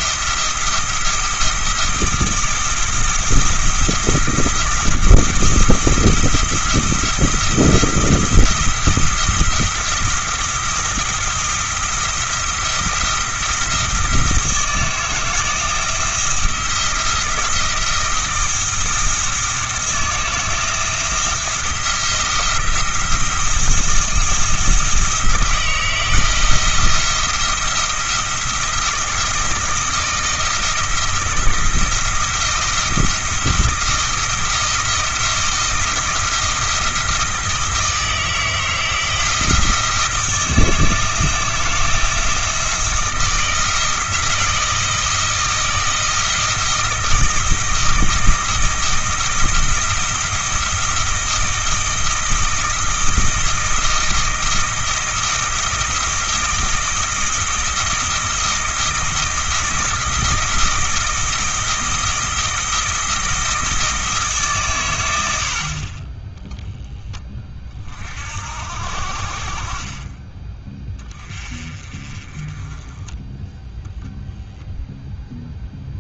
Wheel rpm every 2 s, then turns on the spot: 170, 170, 170, 170, 170, 170, 170, 170, 170, 170, 170, 170, 170, 160, 170, 170, 160, 170, 170, 160, 160, 160, 160, 160, 160, 170, 160, 170, 160, 160, 160, 160, 120, 10, 60, 20, 20, 0.
none